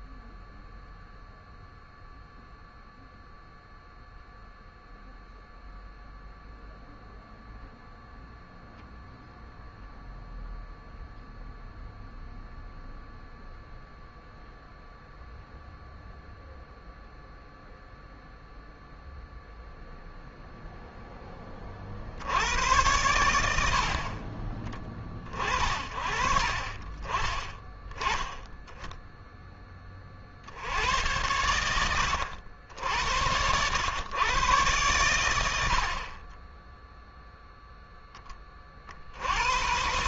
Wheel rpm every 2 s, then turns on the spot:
0, 0, 0, 0, 0, 0, 0, 0, 0, 0, 0, 90, 30, 40, 10, 70, 70, 110, 10, 40.
26-28